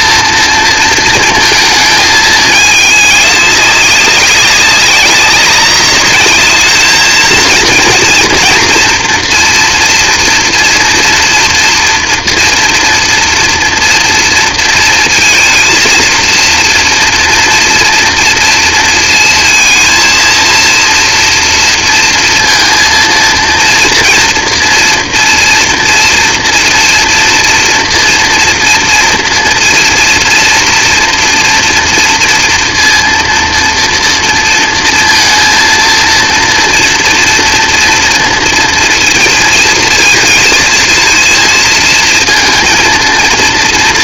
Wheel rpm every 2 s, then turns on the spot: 230, 210, 190, 210, 230, 230, 230, 230, 240, 230, 230, 230, 230, 230, 230, 230, 240, 230, 230, 230, 220, 230.
none